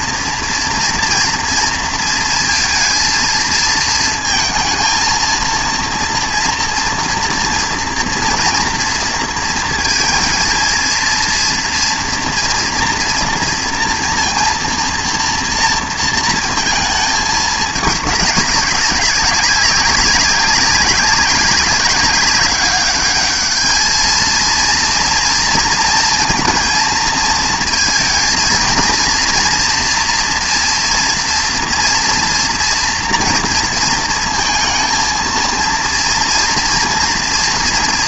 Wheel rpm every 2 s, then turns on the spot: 230, 230, 230, 230, 230, 230, 230, 230, 220, 200, 200, 200, 230, 230, 230, 240, 240, 220, 230.
none